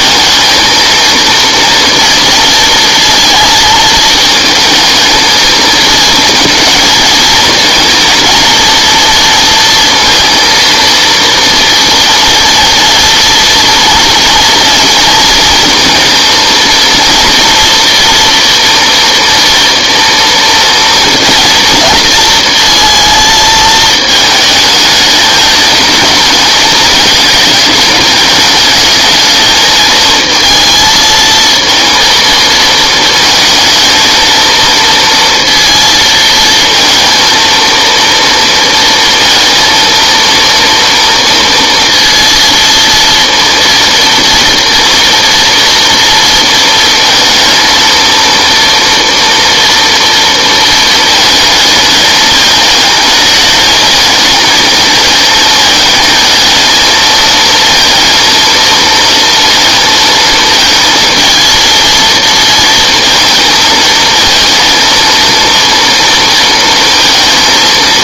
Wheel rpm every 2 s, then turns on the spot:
230, 230, 220, 230, 230, 230, 230, 230, 230, 240, 230, 220, 210, 210, 210, 220, 230, 230, 230, 230, 230, 230, 230, 230, 230, 230, 220, 220, 230, 230, 230, 230, 230, 230.
none